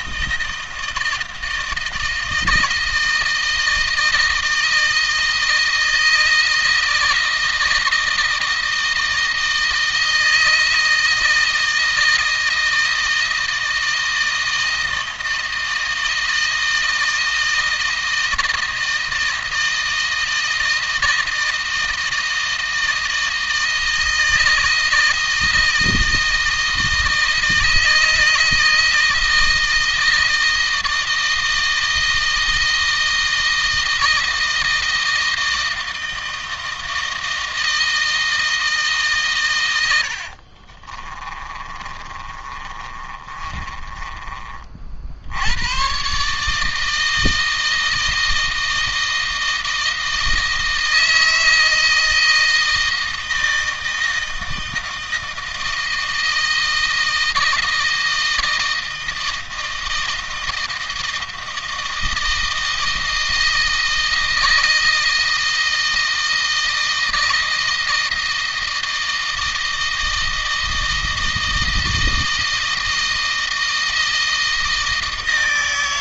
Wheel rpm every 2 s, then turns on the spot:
160, 160, 160, 160, 160, 160, 160, 160, 160, 160, 160, 160, 160, 160, 160, 160, 160, 160, 160, 140, 40, 30, 60, 160, 160, 160, 160, 160, 160, 160, 160, 160, 160, 160, 160, 160, 160, 160.
40-44